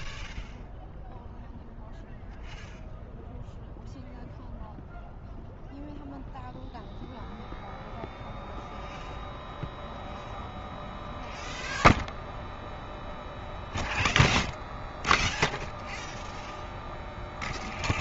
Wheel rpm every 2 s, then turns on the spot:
0, 0, 0, 0, 0, 0, 0, 0, 0.
none